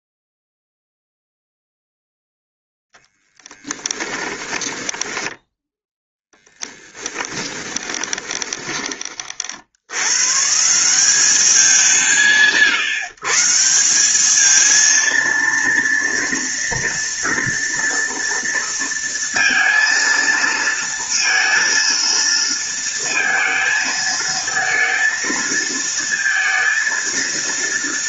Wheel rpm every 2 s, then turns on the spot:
0, 0, 10, 20, 20, 170, 140, 230, 230, 230, 230, 230, 220, 230.
4-10